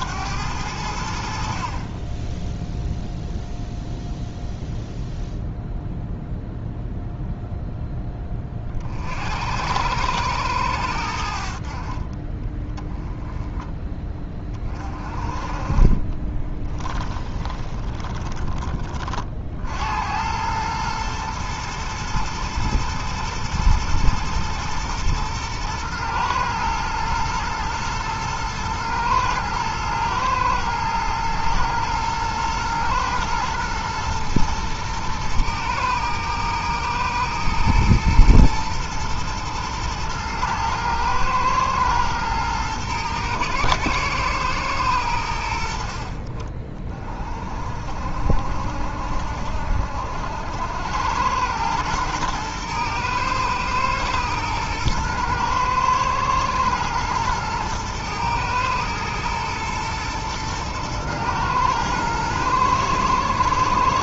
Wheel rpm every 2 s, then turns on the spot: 80, 0, 0, 0, 30, 90, 20, 30, 20, 30, 110, 110, 110, 120, 120, 110, 110, 120, 110, 110, 110, 120, 110, 30, 50, 80, 110, 120, 120, 110, 110, 110.
16-18